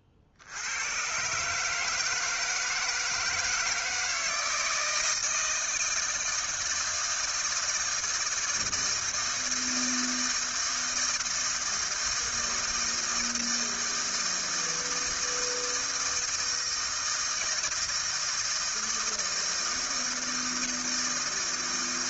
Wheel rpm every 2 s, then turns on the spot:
60, 160, 160, 160, 160, 160, 160, 160, 160, 160, 160.
none